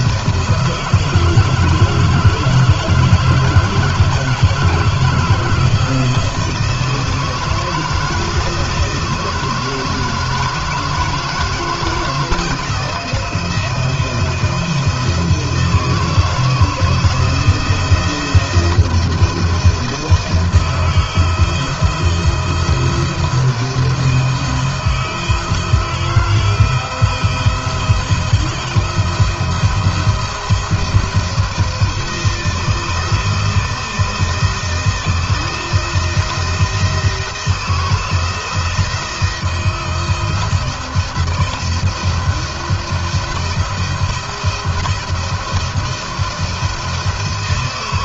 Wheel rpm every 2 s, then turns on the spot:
160, 160, 160, 160, 160, 160, 160, 160, 160, 160, 160, 170, 160, 170, 170, 160, 160, 170, 170, 170, 170, 160, 170, 160.
none